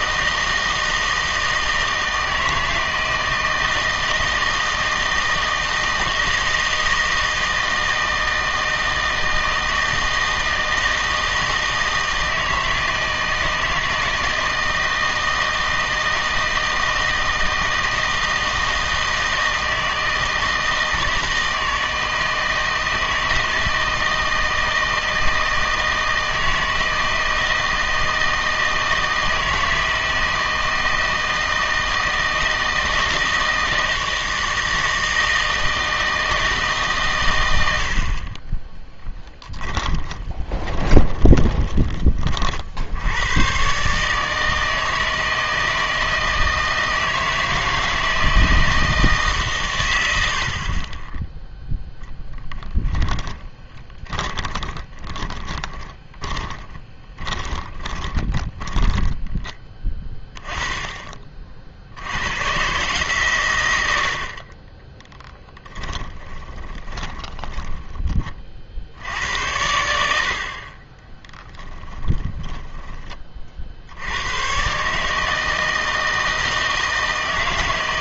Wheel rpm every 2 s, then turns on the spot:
160, 160, 160, 160, 160, 160, 160, 160, 160, 160, 160, 160, 160, 160, 160, 160, 160, 160, 140, 10, 20, 60, 160, 160, 160, 40, 10, 30, 20, 10, 10, 130, 20, 10, 60, 40, 20, 130, 160.
38-42 52-60 66-68